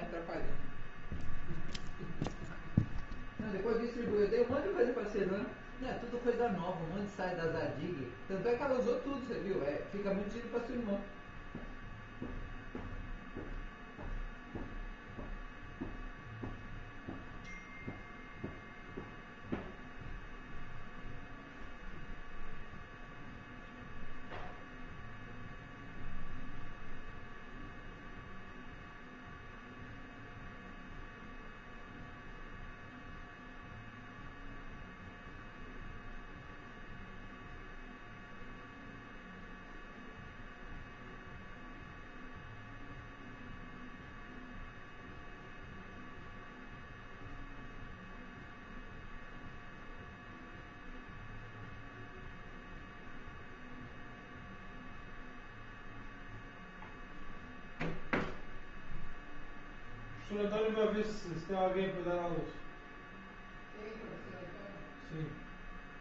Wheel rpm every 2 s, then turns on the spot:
0, 0, 0, 0, 0, 0, 0, 0, 0, 0, 0, 0, 0, 0, 0, 0, 0, 0, 0, 0, 0, 0, 0, 0, 0, 0, 0, 0, 0, 0, 0, 0, 0.
none